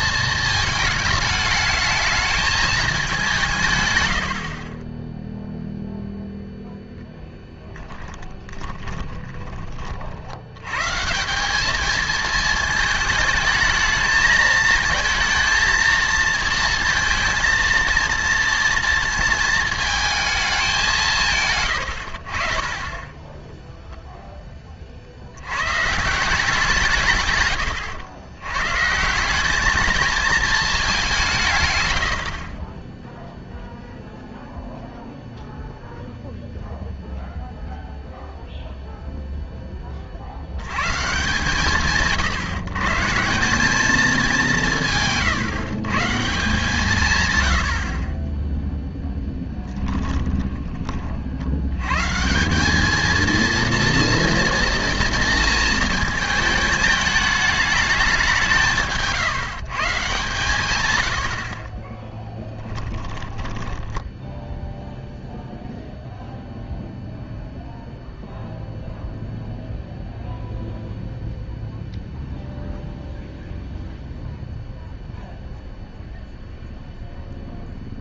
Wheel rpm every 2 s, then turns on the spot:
210, 180, 10, 0, 20, 180, 220, 220, 230, 230, 150, 10, 60, 150, 170, 190, 10, 0, 0, 0, 140, 150, 170, 150, 0, 20, 210, 240, 220, 160, 110, 10, 0, 0, 0, 0, 0, 0, 0.
4-6 8-10 20-22 58-60 62-64